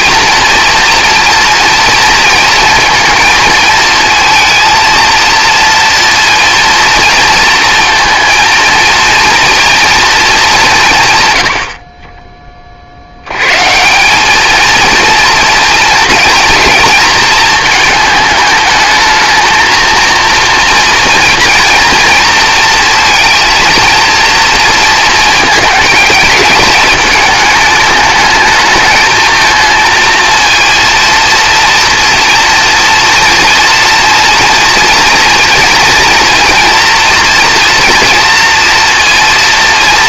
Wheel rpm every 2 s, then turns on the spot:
230, 230, 230, 230, 230, 170, 30, 220, 220, 220, 230, 230, 230, 210, 220, 230, 230, 230, 230, 230.
none